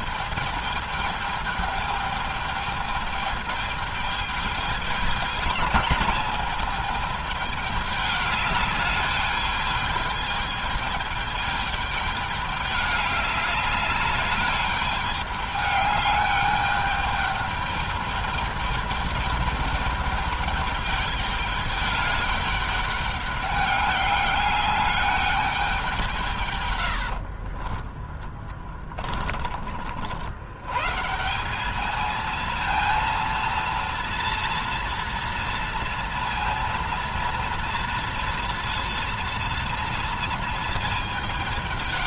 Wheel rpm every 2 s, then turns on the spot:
210, 210, 210, 210, 210, 210, 210, 210, 210, 210, 200, 210, 210, 130, 20, 100, 230, 230, 230, 230, 230.
28-30